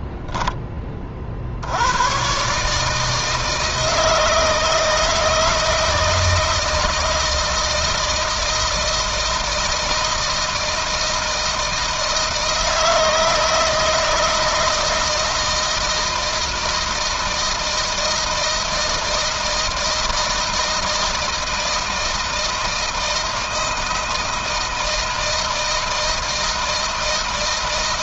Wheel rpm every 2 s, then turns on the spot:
30, 150, 160, 160, 160, 160, 160, 160, 160, 160, 160, 160, 160, 160.
none